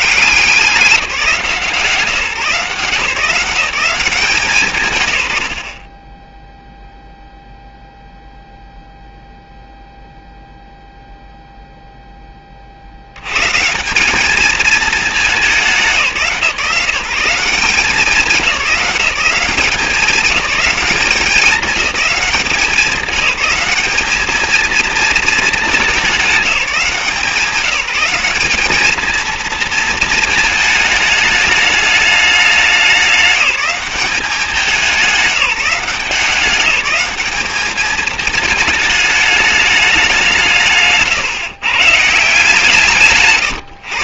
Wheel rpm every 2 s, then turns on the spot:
180, 160, 170, 0, 0, 0, 30, 220, 160, 190, 200, 200, 220, 180, 200, 220, 210, 190, 200, 220, 160, 160.
none